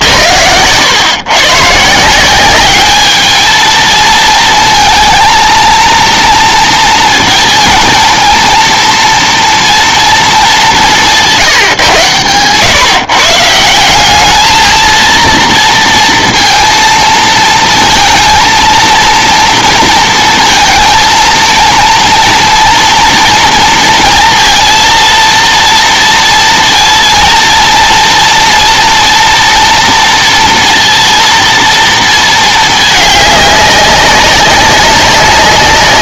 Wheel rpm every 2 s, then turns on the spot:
100, 190, 230, 230, 230, 190, 130, 220, 230, 230, 230, 230, 230, 230, 230, 230, 220, 190.
none